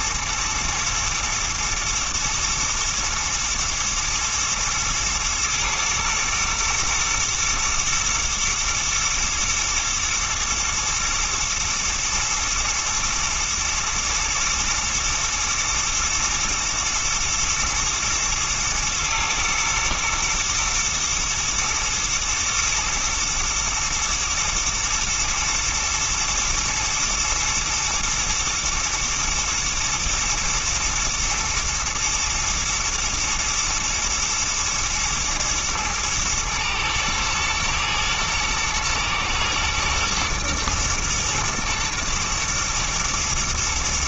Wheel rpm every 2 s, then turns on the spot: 110, 120, 120, 120, 110, 120, 110, 120, 120, 110, 110, 120, 110, 120, 110, 120, 110, 110, 110, 110, 120, 120.
none